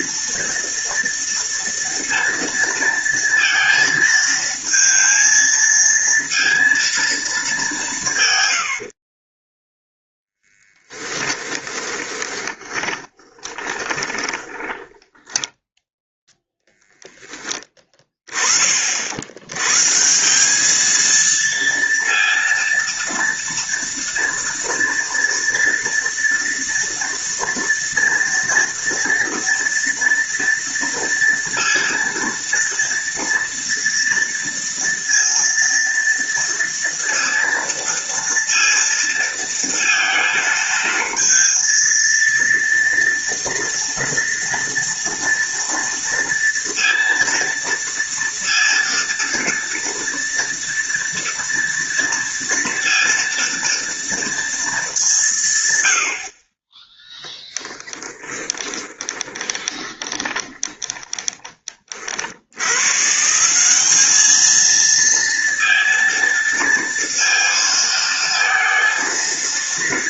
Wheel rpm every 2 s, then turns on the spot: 230, 230, 220, 230, 70, 30, 20, 10, 0, 60, 220, 230, 230, 230, 230, 230, 230, 230, 230, 230, 230, 230, 230, 230, 230, 230, 230, 220, 10, 20, 10, 130, 230, 230, 230.
8-16 58-62